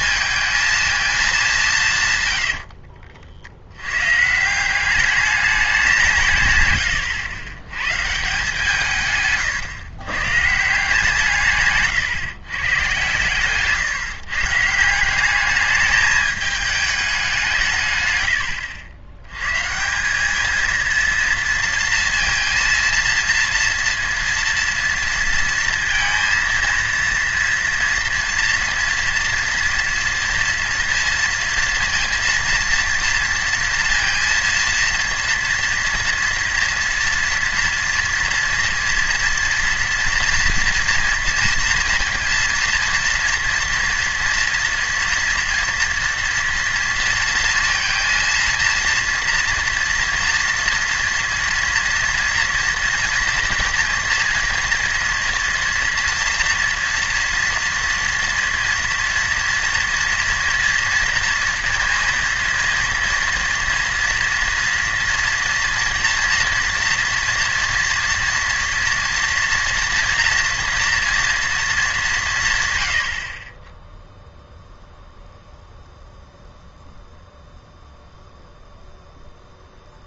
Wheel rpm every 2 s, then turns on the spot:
220, 90, 160, 140, 160, 150, 130, 160, 210, 100, 220, 230, 230, 230, 230, 230, 230, 230, 230, 230, 230, 230, 230, 230, 230, 230, 240, 230, 230, 230, 230, 230, 230, 230, 230, 230, 140, 0, 0, 0.
2-4 6-8